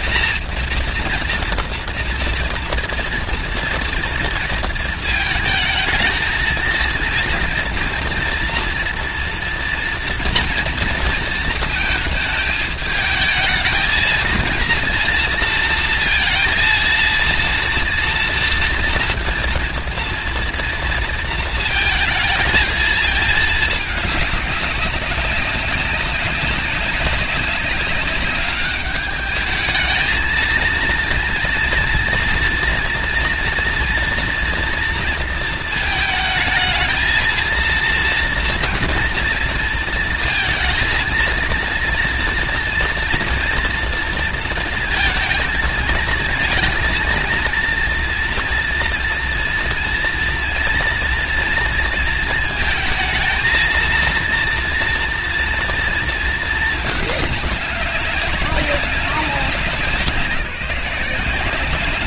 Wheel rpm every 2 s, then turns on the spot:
240, 230, 230, 220, 230, 230, 220, 230, 230, 230, 230, 230, 200, 190, 200, 230, 230, 240, 220, 230, 230, 230, 230, 230, 230, 230, 220, 240, 220, 190, 170.
none